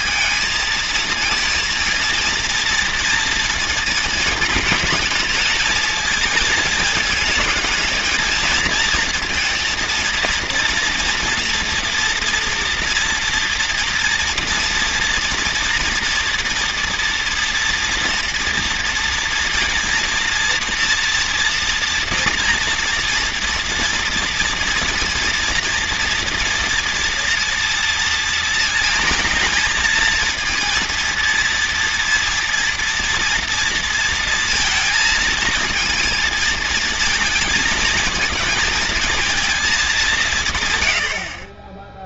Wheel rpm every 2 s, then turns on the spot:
220, 230, 220, 220, 230, 230, 230, 230, 230, 230, 230, 230, 240, 230, 230, 240, 240, 220, 220, 220, 110.
none